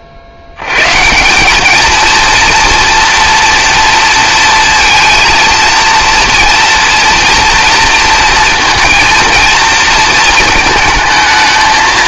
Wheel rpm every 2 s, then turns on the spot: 110, 230, 230, 230, 230, 220.
none